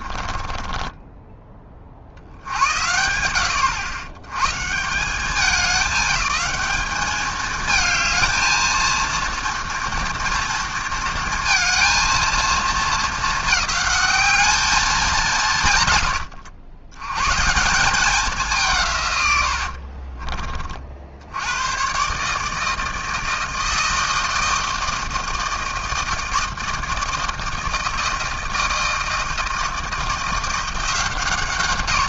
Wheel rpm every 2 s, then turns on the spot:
20, 80, 130, 200, 230, 230, 230, 210, 90, 190, 40, 150, 160, 160, 160, 170.
0-2